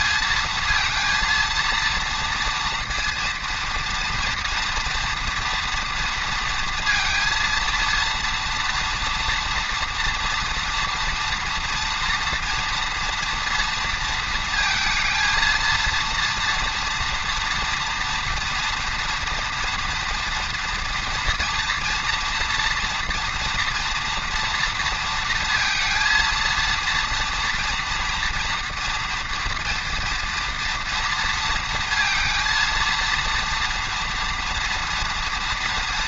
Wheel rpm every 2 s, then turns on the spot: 230, 230, 230, 230, 230, 230, 230, 230, 230, 230, 230, 230, 230, 230, 230, 230, 230, 230.
none